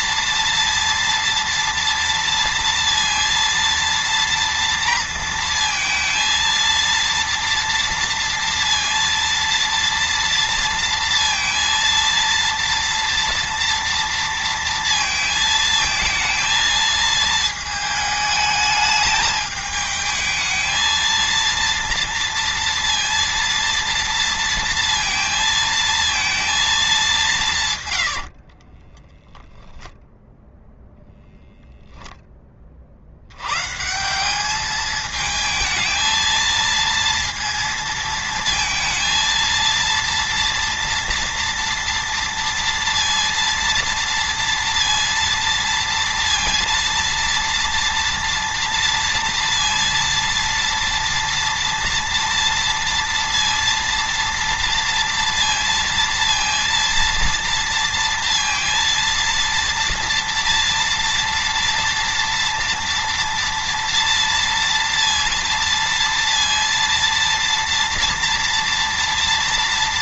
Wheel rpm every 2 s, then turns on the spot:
230, 230, 230, 230, 230, 230, 230, 230, 220, 210, 220, 230, 230, 210, 20, 0, 50, 220, 230, 230, 230, 230, 230, 230, 230, 230, 230, 230, 230, 230, 230, 230, 230, 230, 230.
28-30